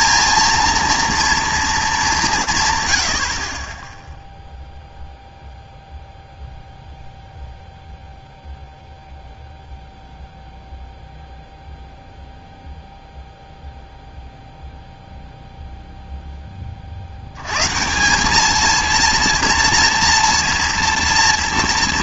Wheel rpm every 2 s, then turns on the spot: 230, 120, 0, 0, 0, 0, 0, 0, 40, 230, 230.
none